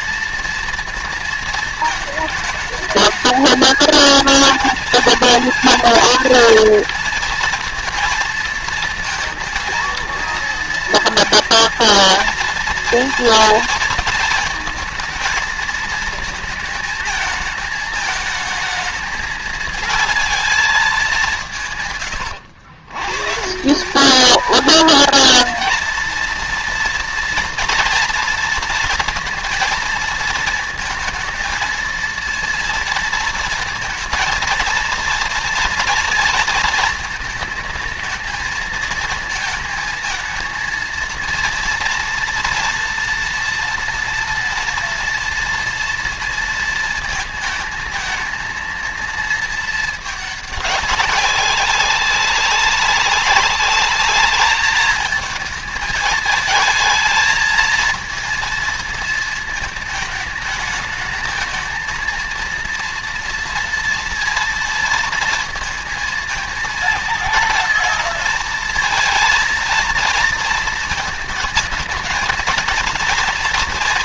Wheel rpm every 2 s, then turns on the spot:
220, 220, 230, 230, 230, 230, 230, 220, 220, 220, 200, 120, 230, 230, 230, 230, 230, 230, 220, 220, 230, 230, 230, 230, 230, 200, 200, 220, 220, 220, 220, 230, 230, 230, 230, 230, 230.
none